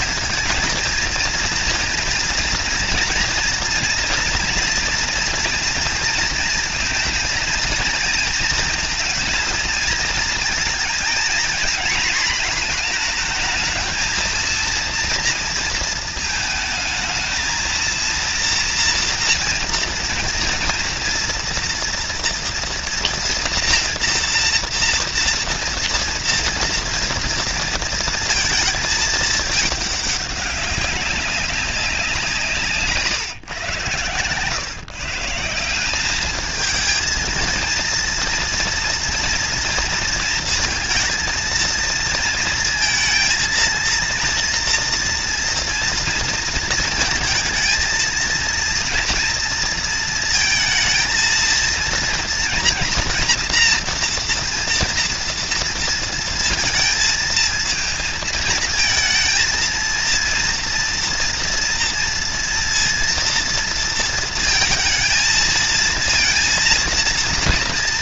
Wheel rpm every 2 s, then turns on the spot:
230, 240, 230, 230, 230, 230, 230, 230, 220, 240, 230, 230, 230, 230, 220, 200, 140, 150, 230, 230, 230, 220, 230, 230, 230, 230, 230, 230, 220, 220, 230, 230, 230, 230.
none